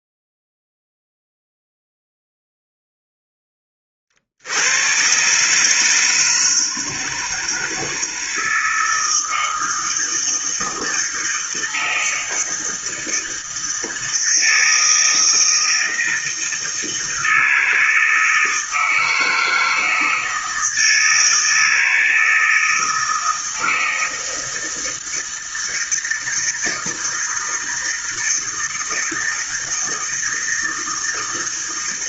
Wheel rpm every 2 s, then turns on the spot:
0, 0, 100, 160, 160, 160, 160, 160, 160, 160, 160, 160, 160, 160, 160, 160.
none